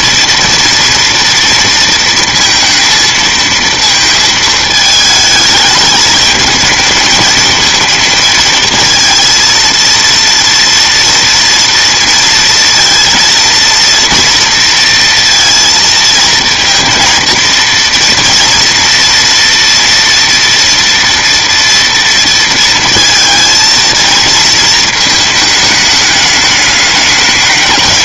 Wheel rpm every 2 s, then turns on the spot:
230, 230, 220, 210, 220, 230, 230, 230, 230, 230, 230, 230, 220, 210.
none